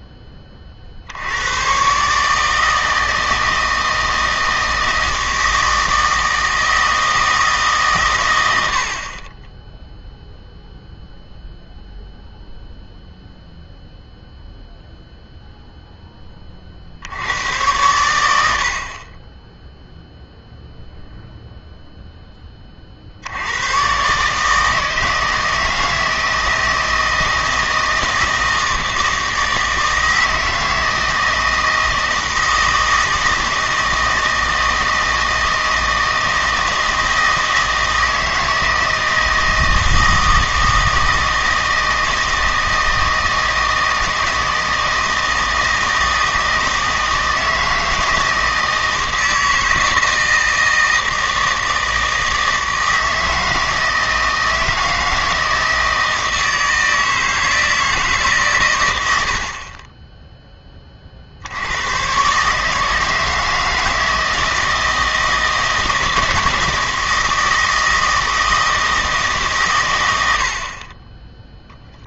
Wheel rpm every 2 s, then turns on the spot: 40, 160, 160, 160, 70, 0, 0, 0, 40, 60, 0, 40, 160, 160, 160, 160, 160, 160, 160, 160, 160, 160, 160, 160, 160, 160, 160, 160, 160, 120, 20, 150, 160, 160, 160, 40.
none